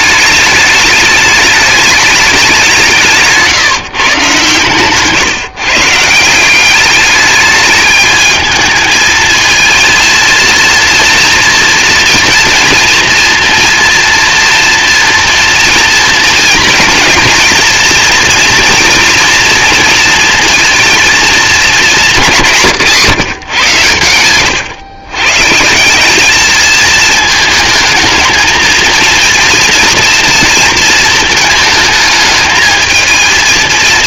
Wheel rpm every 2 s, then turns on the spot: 210, 170, 140, 190, 220, 230, 230, 230, 240, 230, 230, 160, 120, 220, 230, 230, 220.
none